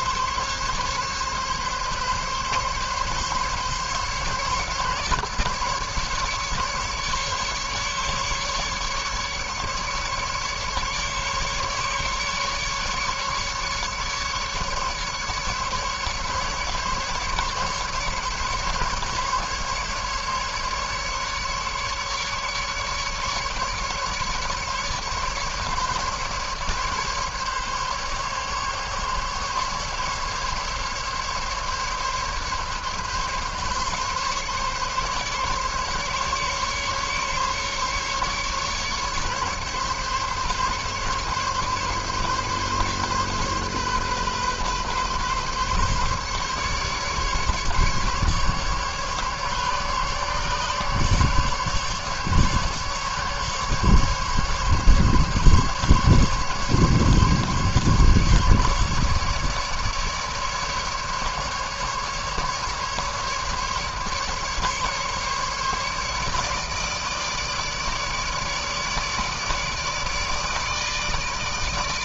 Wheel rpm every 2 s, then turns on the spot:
140, 140, 140, 150, 140, 140, 150, 140, 150, 150, 150, 150, 150, 150, 140, 140, 140, 140, 140, 140, 140, 140, 130, 140, 140, 140, 140, 140, 140, 140, 150, 150, 140, 150, 150, 150.
none